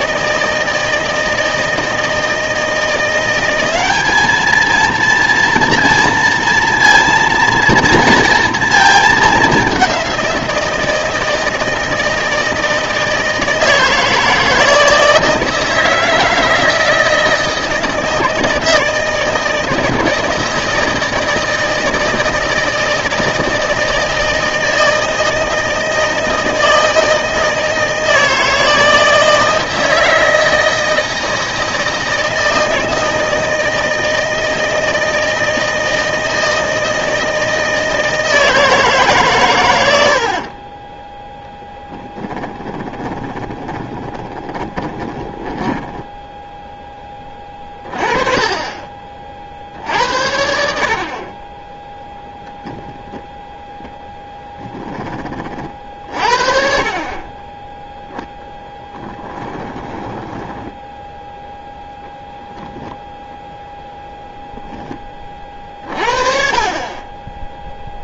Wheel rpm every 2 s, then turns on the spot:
160, 160, 220, 230, 230, 170, 160, 160, 160, 160, 160, 160, 160, 160, 160, 160, 160, 160, 160, 160, 30, 20, 20, 0, 40, 70, 20, 10, 40, 10, 10, 0, 0, 30.
40-46 52-54